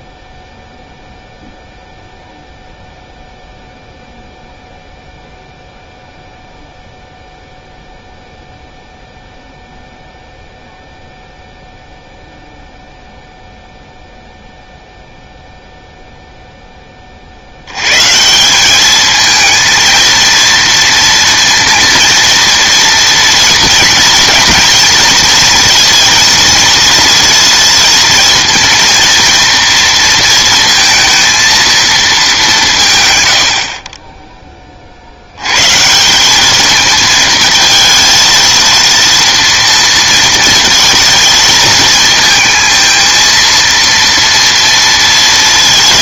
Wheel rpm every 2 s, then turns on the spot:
0, 0, 0, 0, 0, 0, 0, 0, 10, 190, 230, 230, 220, 230, 230, 230, 190, 30, 220, 230, 230, 220, 230.
none